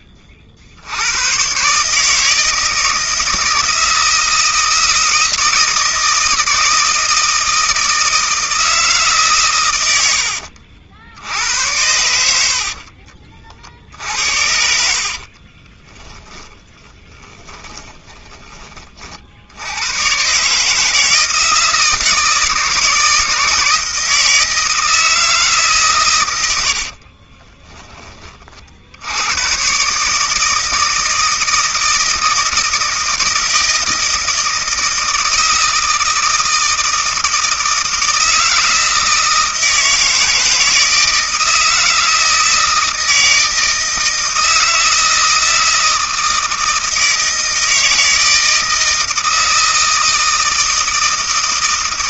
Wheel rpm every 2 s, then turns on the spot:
40, 160, 160, 160, 160, 80, 70, 60, 30, 30, 140, 160, 160, 80, 40, 160, 160, 160, 160, 160, 160, 160, 160, 160, 160, 160.
10-12 14-20